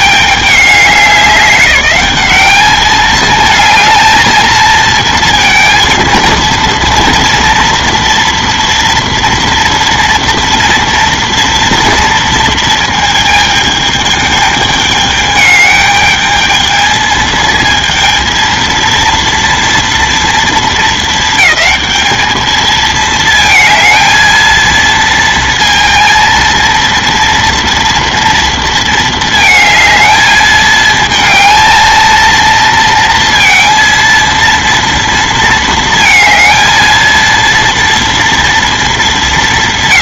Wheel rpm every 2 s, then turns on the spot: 200, 210, 230, 230, 230, 230, 230, 210, 220, 230, 220, 220, 230, 230, 230, 220, 230, 230, 220, 230.
none